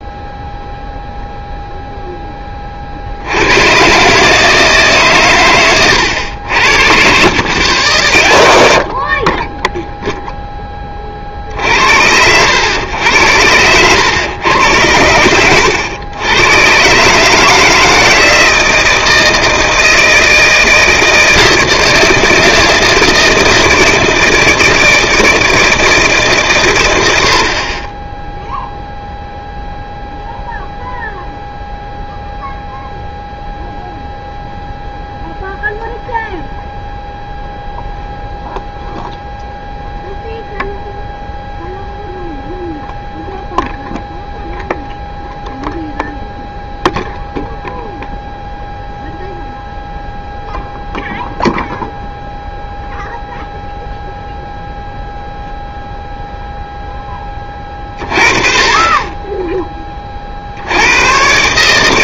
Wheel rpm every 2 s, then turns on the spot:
0, 40, 150, 60, 60, 30, 90, 90, 130, 160, 160, 160, 160, 110, 0, 0, 0, 0, 0, 0, 0, 0, 0, 0, 0, 0, 0, 0, 0, 30, 90.
none